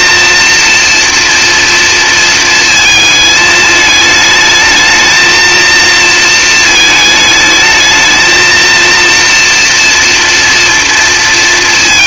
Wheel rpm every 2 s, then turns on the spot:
240, 230, 220, 220, 230, 230.
none